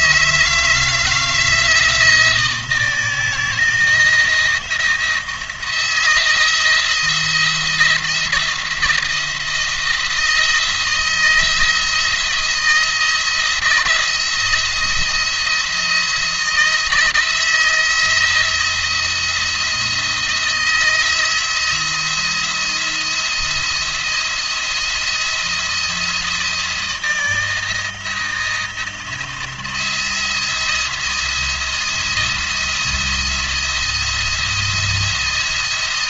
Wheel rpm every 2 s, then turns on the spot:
160, 170, 170, 170, 170, 170, 170, 170, 160, 160, 170, 170, 170, 160, 170, 170, 170, 170.
none